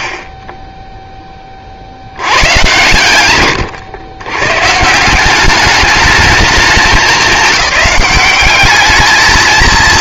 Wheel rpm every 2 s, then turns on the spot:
20, 120, 130, 220, 200.
none